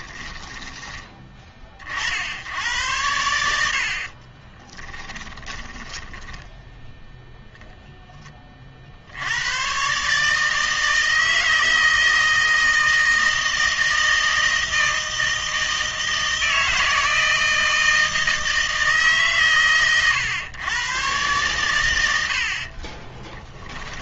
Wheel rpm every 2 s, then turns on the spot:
20, 90, 20, 10, 50, 160, 160, 160, 160, 160, 120, 50.
4-6